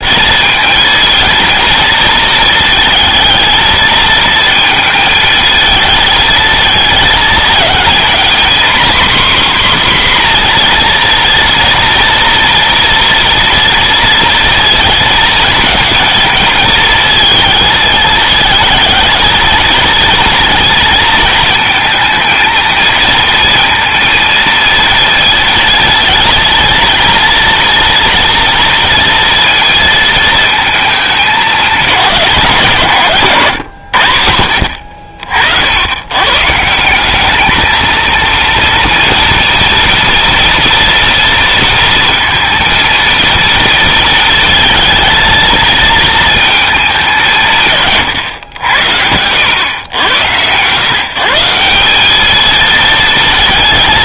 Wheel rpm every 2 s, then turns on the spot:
220, 220, 220, 220, 260, 240, 230, 230, 220, 220, 230, 230, 230, 230, 230, 220, 160, 70, 170, 230, 240, 230, 230, 220, 90, 130, 220.
none